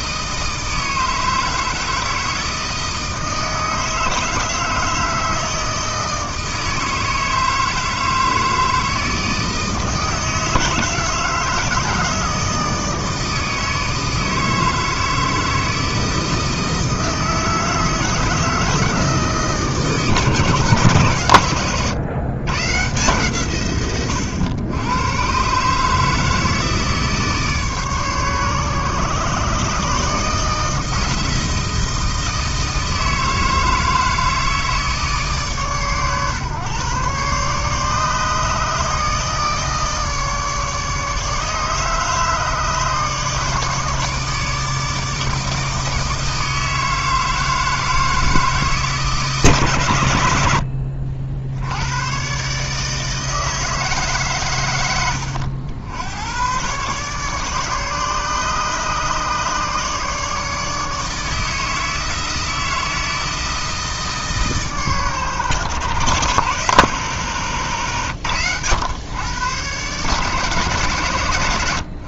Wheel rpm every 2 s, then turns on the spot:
160, 160, 160, 160, 160, 160, 160, 160, 160, 150, 110, 130, 140, 150, 140, 160, 160, 140, 140, 150, 150, 150, 160, 160, 150, 60, 160, 90, 140, 150, 160, 160, 130, 130, 110, 140.
54-56